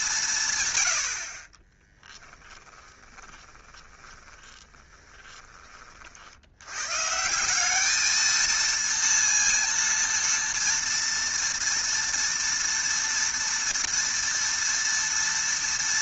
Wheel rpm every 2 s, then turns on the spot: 110, 10, 10, 100, 230, 230, 230, 230.
2-6